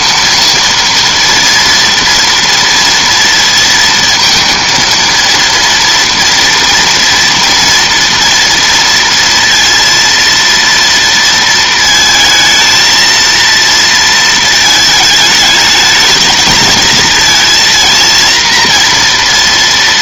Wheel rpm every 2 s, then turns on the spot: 230, 240, 230, 230, 230, 230, 220, 220, 220, 230.
none